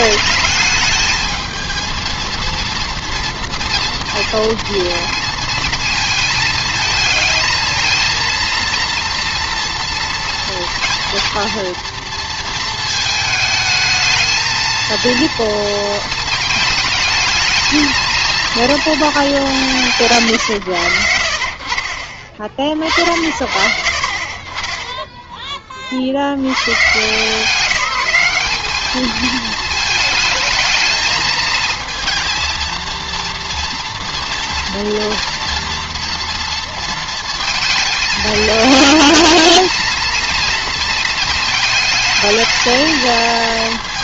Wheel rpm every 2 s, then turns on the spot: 220, 230, 230, 220, 230, 230, 220, 220, 220, 230, 90, 50, 20, 110, 200, 220, 230, 230, 230, 220, 230, 220.
none